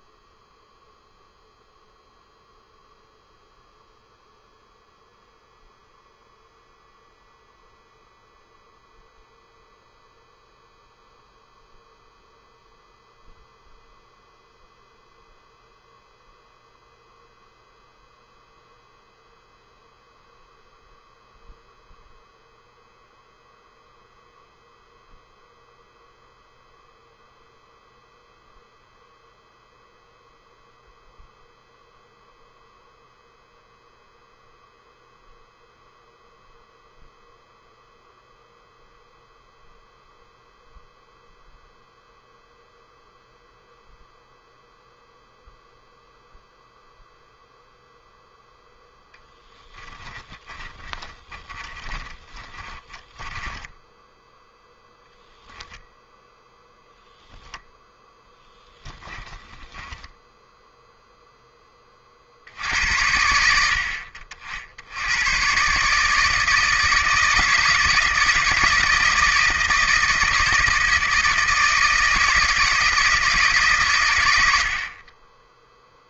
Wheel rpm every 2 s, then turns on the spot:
0, 0, 0, 0, 0, 0, 0, 0, 0, 0, 0, 0, 0, 0, 0, 0, 0, 0, 0, 0, 0, 0, 0, 0, 0, 20, 10, 0, 0, 10, 0, 80, 80, 160, 160, 160, 160, 50.
50-54 58-60